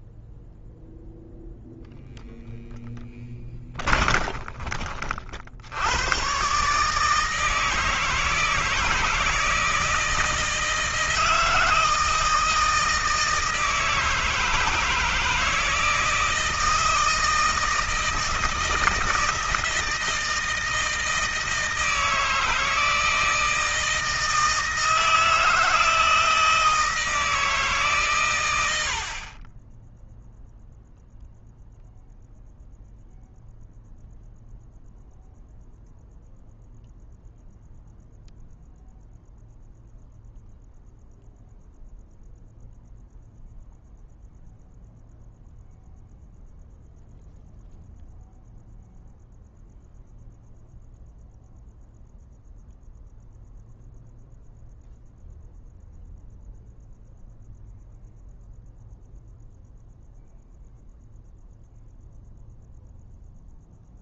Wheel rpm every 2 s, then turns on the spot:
0, 10, 30, 140, 160, 160, 160, 160, 160, 160, 160, 160, 160, 160, 110, 0, 0, 0, 0, 0, 0, 0, 0, 0, 0, 0, 0, 0, 0, 0, 0, 0.
none